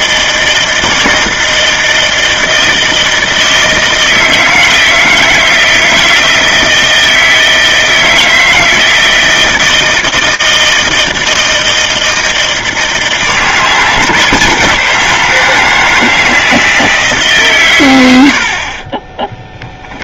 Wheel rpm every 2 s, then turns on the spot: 160, 160, 160, 160, 160, 160, 160, 160, 150, 20.
18-20